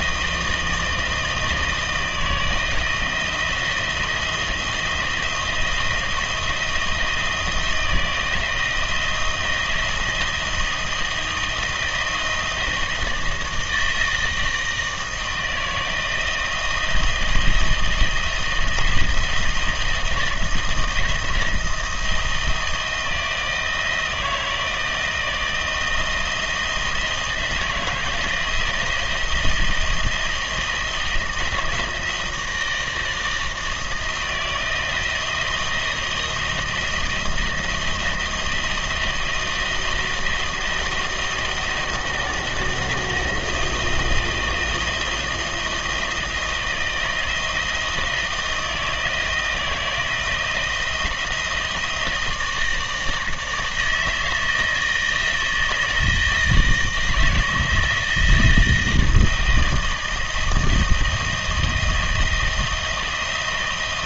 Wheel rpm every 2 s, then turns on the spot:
160, 160, 160, 170, 160, 160, 160, 160, 160, 160, 160, 170, 160, 160, 160, 170, 160, 170, 170, 160, 160, 160, 160, 160, 160, 160, 160, 160, 160, 160, 160, 160.
none